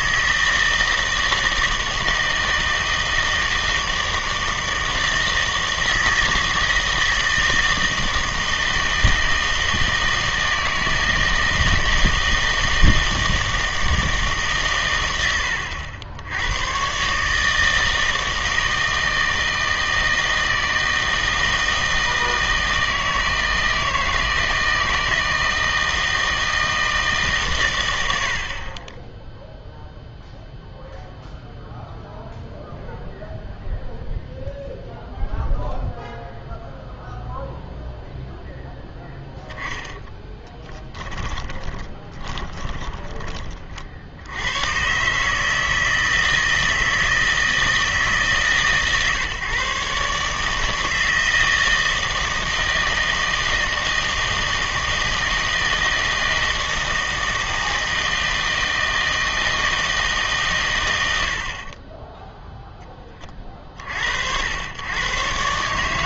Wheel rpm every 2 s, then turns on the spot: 160, 160, 160, 160, 160, 160, 160, 120, 110, 160, 160, 160, 160, 160, 20, 0, 0, 0, 0, 0, 10, 20, 110, 160, 140, 160, 160, 160, 160, 160, 100, 10, 100.
40-44